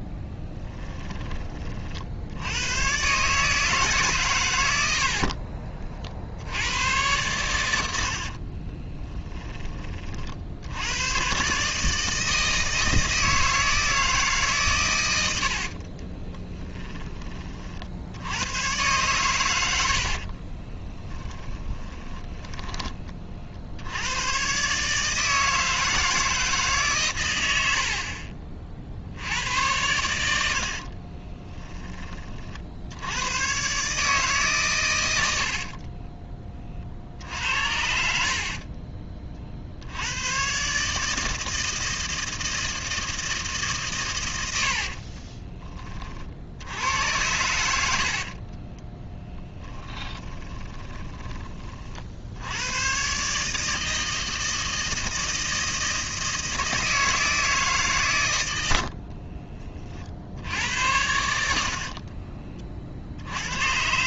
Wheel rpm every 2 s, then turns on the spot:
10, 110, 80, 100, 30, 80, 160, 120, 10, 110, 20, 30, 140, 150, 50, 60, 60, 120, 40, 30, 140, 160, 70, 80, 20, 10, 110, 160, 160, 70, 80, 40.
8-10 20-22 30-32 44-46 48-52